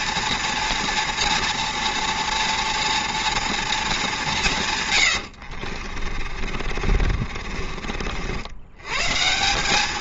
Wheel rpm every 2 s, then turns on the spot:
230, 230, 140, 40, 100.
6-8